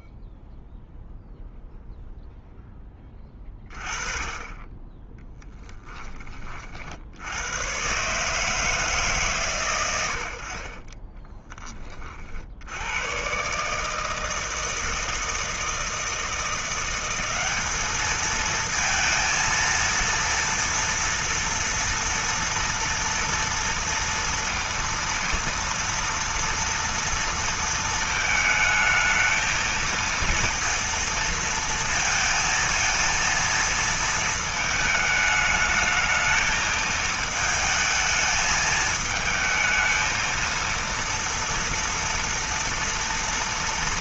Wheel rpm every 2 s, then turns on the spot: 0, 0, 20, 40, 150, 80, 60, 160, 170, 220, 230, 230, 230, 230, 220, 230, 230, 220, 220, 220, 230, 230.
none